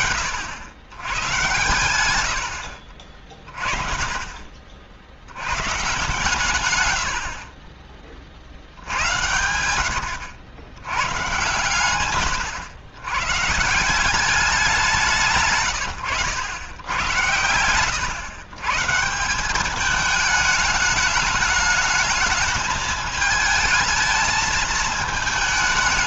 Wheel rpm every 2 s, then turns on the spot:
90, 80, 50, 120, 70, 100, 100, 190, 100, 130, 210, 220, 220.
none